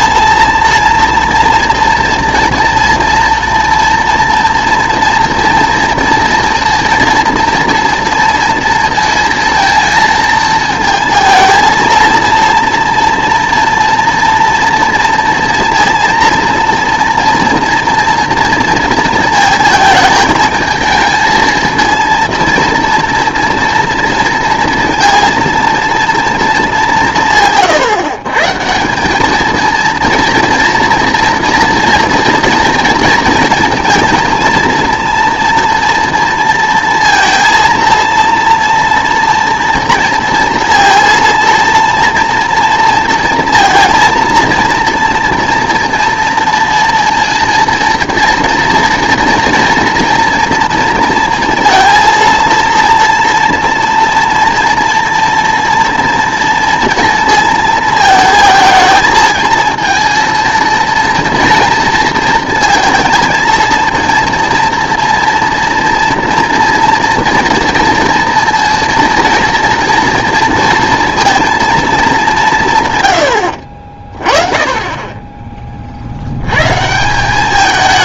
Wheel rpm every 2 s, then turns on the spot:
230, 230, 240, 230, 230, 220, 240, 230, 230, 230, 220, 230, 230, 200, 170, 230, 230, 230, 230, 240, 230, 230, 230, 230, 230, 230, 230, 230, 230, 220, 230, 230, 230, 230, 230, 230, 160, 20, 150.
none